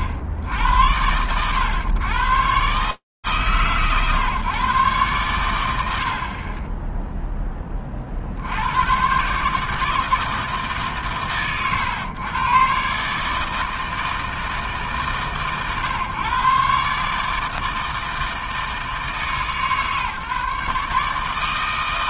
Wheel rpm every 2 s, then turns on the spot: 80, 130, 130, 10, 100, 150, 120, 140, 120, 160, 150.
6-8